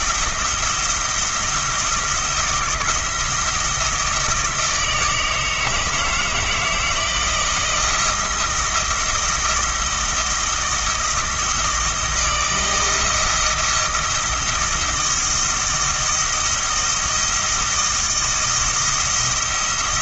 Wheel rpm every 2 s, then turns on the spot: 170, 170, 160, 160, 170, 160, 160, 160, 170, 170.
none